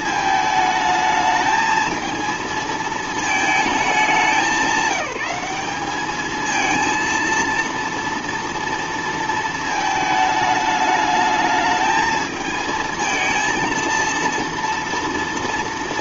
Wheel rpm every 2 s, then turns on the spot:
220, 220, 190, 230, 230, 210, 220, 230.
none